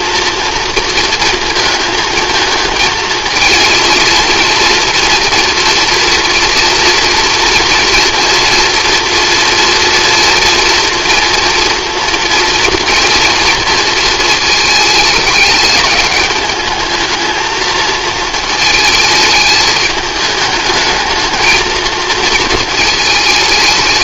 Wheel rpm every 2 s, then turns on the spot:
230, 220, 240, 230, 230, 230, 230, 220, 220, 220, 220, 220.
none